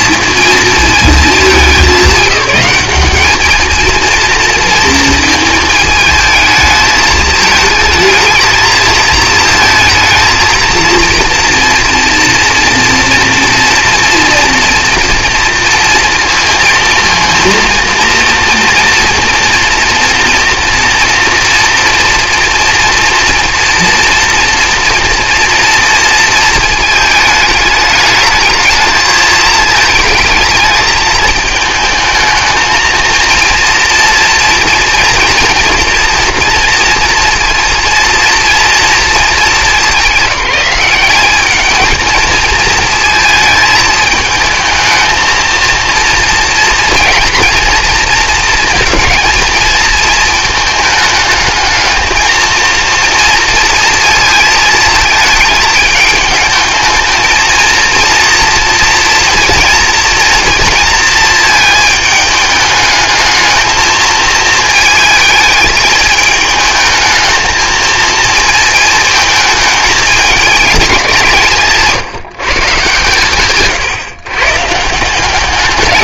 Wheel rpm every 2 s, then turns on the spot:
230, 200, 230, 220, 220, 230, 230, 230, 230, 230, 230, 230, 230, 220, 220, 220, 220, 230, 230, 230, 200, 220, 220, 230, 220, 220, 230, 220, 220, 230, 230, 210, 220, 220, 220, 210, 140, 160.
none